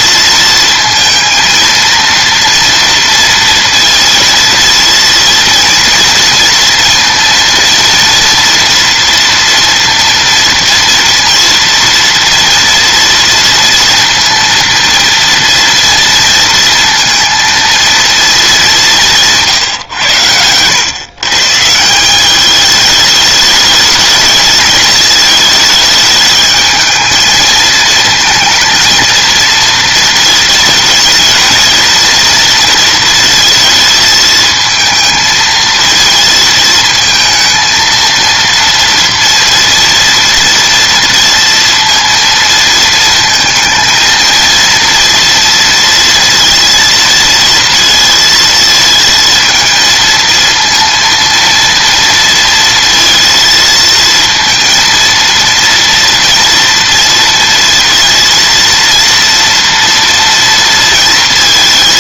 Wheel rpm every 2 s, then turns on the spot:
230, 230, 230, 230, 240, 230, 230, 230, 230, 200, 120, 210, 220, 220, 230, 220, 230, 220, 220, 230, 230, 230, 230, 230, 220, 230, 230, 230, 230, 230, 230.
none